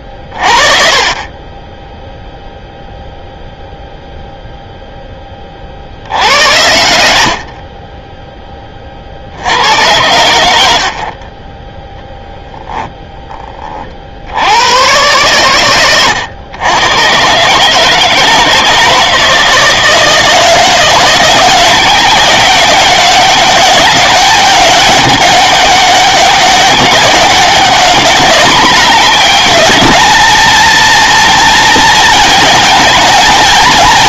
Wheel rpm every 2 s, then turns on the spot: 40, 0, 0, 100, 20, 90, 10, 90, 110, 160, 170, 190, 200, 200, 210, 230, 220.
12-14